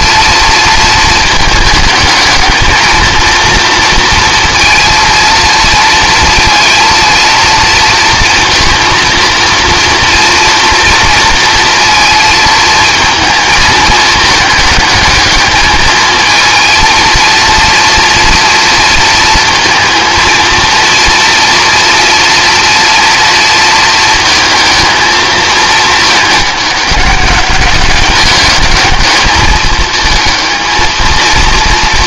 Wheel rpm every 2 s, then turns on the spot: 230, 220, 230, 230, 230, 230, 230, 210, 230, 230, 230, 230, 220, 210, 210, 220.
none